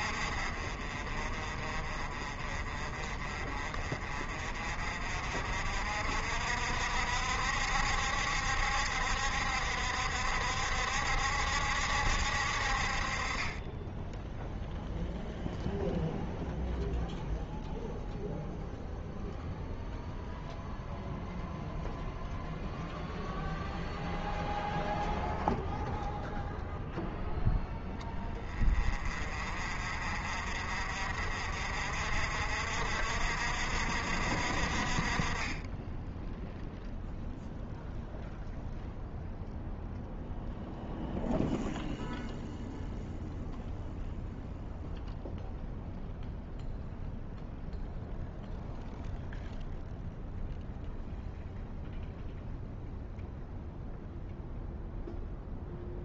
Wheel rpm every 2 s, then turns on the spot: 40, 40, 40, 60, 70, 70, 60, 0, 0, 0, 0, 0, 0, 0, 20, 50, 60, 50, 0, 0, 0, 0, 0, 0, 0, 0, 0, 0.
none